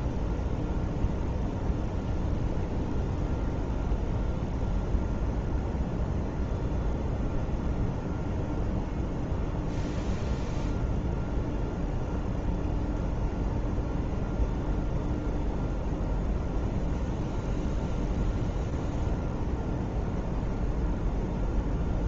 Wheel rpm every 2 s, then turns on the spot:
0, 0, 0, 0, 0, 0, 0, 0, 0, 0, 0.
none